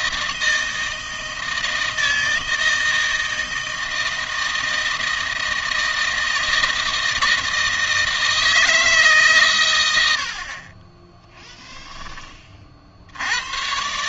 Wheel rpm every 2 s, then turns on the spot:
160, 160, 160, 160, 160, 30, 30.
none